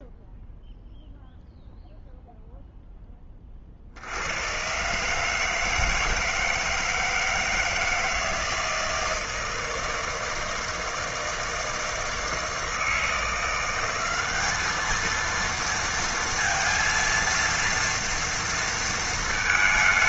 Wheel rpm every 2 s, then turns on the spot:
0, 0, 110, 160, 160, 160, 160, 210, 230, 230.
none